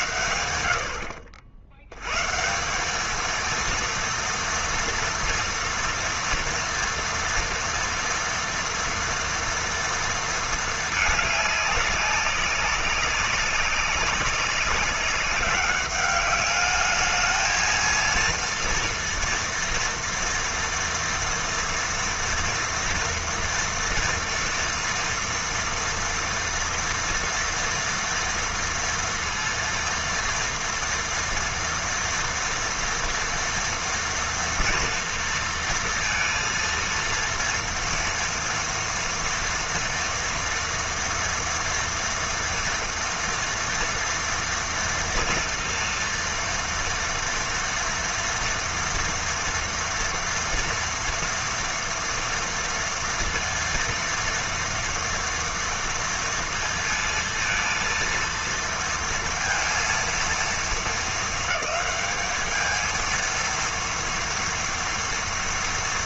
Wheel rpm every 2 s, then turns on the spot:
70, 190, 230, 230, 230, 220, 200, 200, 210, 230, 230, 230, 230, 230, 230, 230, 230, 240, 230, 230, 230, 230, 230, 230, 230, 240, 230, 230, 230, 230, 220, 220, 230.
none